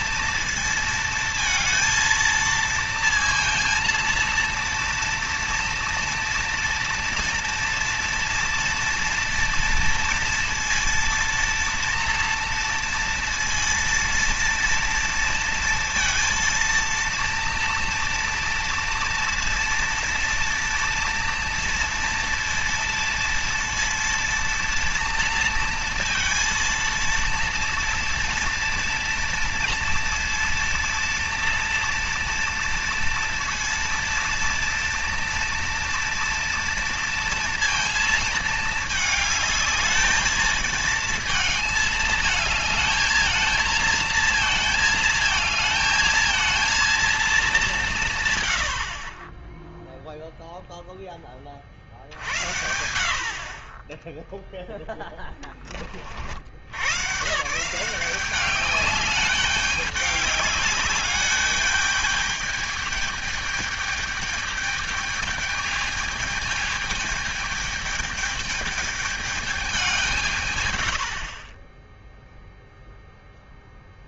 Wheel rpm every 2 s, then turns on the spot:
230, 230, 230, 240, 230, 230, 230, 230, 230, 230, 230, 230, 230, 230, 230, 230, 230, 230, 230, 220, 220, 220, 220, 230, 100, 0, 70, 0, 90, 200, 200, 210, 210, 220, 210, 120, 0.
none